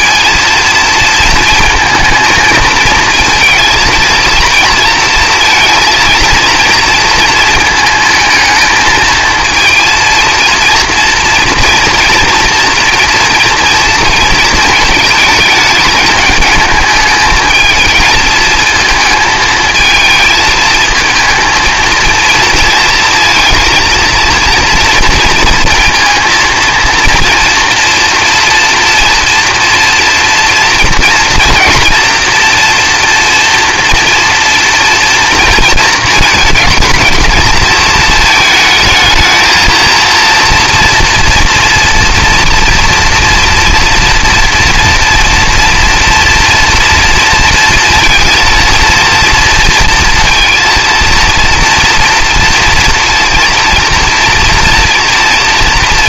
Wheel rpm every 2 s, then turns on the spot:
230, 220, 230, 230, 220, 230, 230, 220, 210, 220, 220, 230, 230, 230, 230, 230, 240, 240, 220, 220, 230, 230, 230, 230, 230, 230, 230, 230.
none